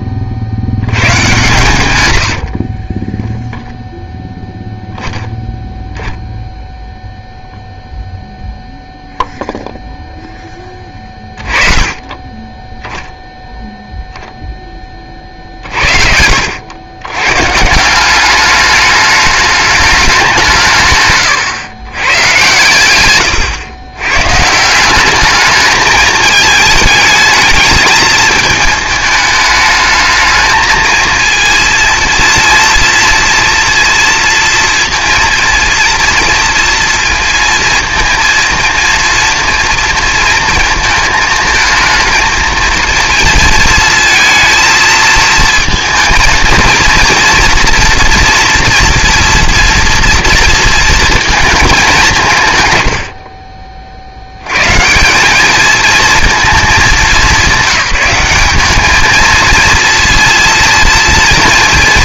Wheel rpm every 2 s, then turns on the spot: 100, 30, 10, 0, 0, 10, 10, 20, 90, 210, 140, 120, 180, 220, 220, 220, 230, 230, 230, 230, 220, 220, 220, 230, 230, 230, 110, 130, 210, 200, 230.
2-4